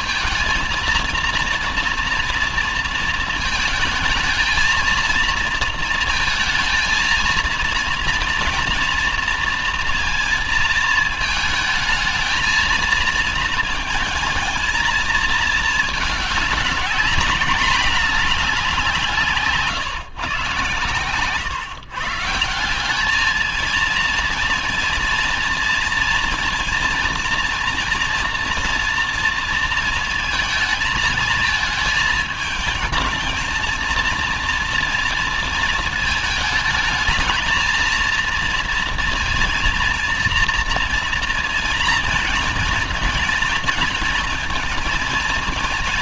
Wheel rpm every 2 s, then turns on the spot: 230, 230, 220, 230, 230, 220, 230, 230, 210, 180, 130, 190, 230, 230, 230, 220, 220, 230, 220, 230, 230, 230, 230.
none